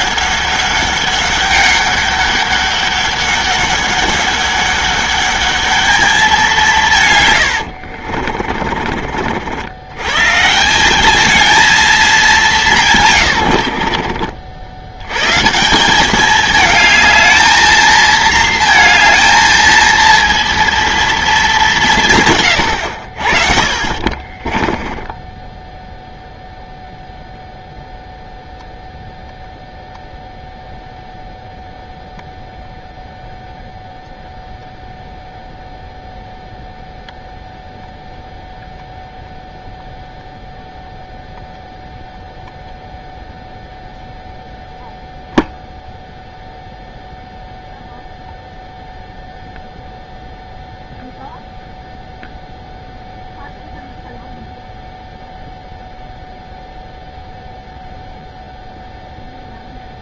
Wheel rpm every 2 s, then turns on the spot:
200, 200, 200, 200, 60, 120, 200, 60, 190, 230, 230, 170, 40, 0, 0, 0, 0, 0, 0, 0, 0, 0, 0, 0, 0, 0, 0, 0, 0, 0.
8-10 24-26